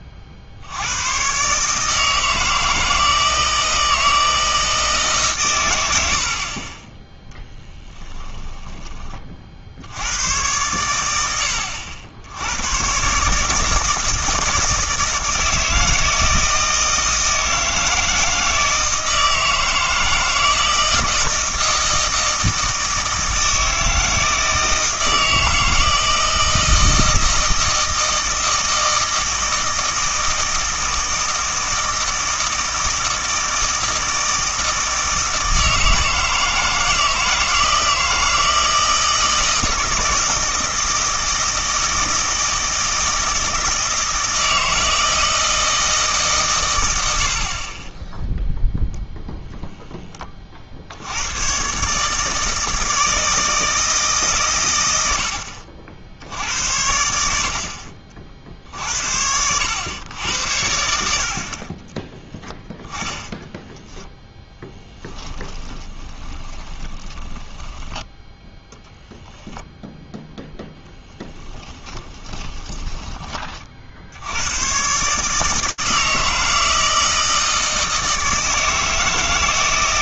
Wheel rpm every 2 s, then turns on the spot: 90, 160, 160, 20, 20, 110, 110, 160, 160, 160, 170, 160, 160, 160, 160, 160, 160, 160, 160, 160, 160, 160, 160, 120, 0, 60, 160, 100, 80, 60, 90, 10, 10, 20, 0, 0, 20, 120, 160, 160.
64-68 72-74